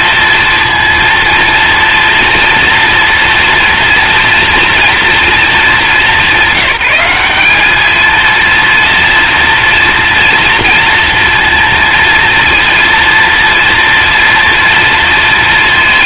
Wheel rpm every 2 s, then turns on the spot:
230, 230, 230, 190, 230, 230, 230, 230.
none